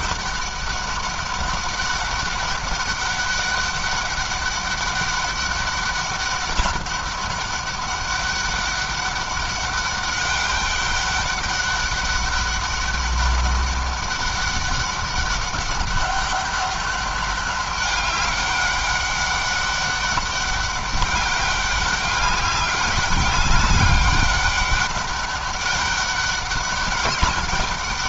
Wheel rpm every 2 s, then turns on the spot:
200, 200, 200, 200, 200, 200, 200, 200, 200, 200, 200, 200, 200, 200.
none